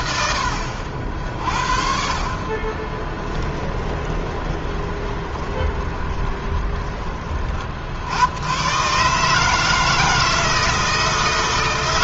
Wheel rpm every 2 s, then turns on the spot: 60, 20, 20, 30, 130, 160.
2-6